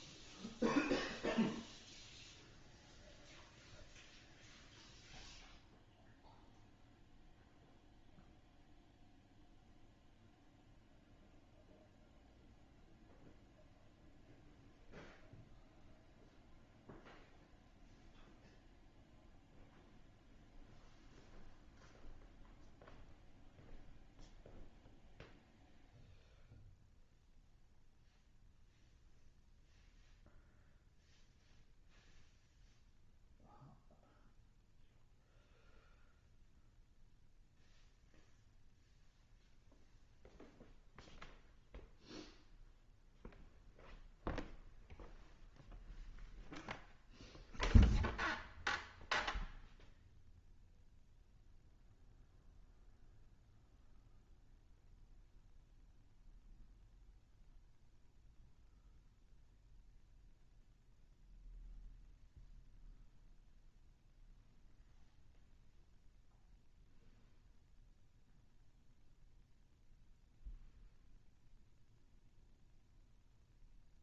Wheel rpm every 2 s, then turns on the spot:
0, 0, 0, 0, 0, 0, 0, 0, 0, 0, 0, 0, 0, 0, 0, 0, 0, 0, 0, 0, 0, 0, 0, 0, 0, 0, 0, 0, 0, 0, 0, 0, 0, 0, 0, 0, 0.
none